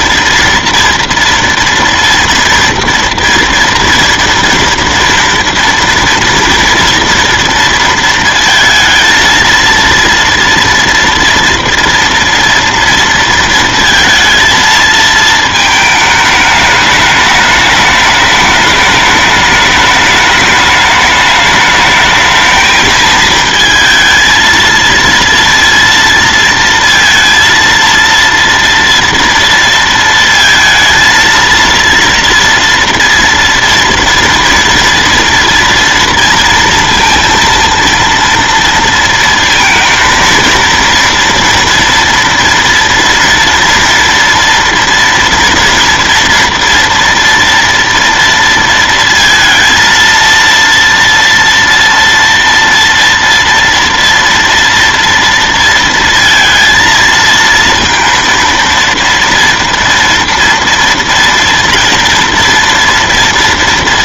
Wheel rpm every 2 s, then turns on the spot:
230, 230, 230, 230, 230, 230, 230, 230, 210, 210, 210, 220, 230, 230, 230, 230, 240, 230, 230, 230, 230, 230, 230, 230, 230, 230, 230, 230, 230, 230, 230, 230.
none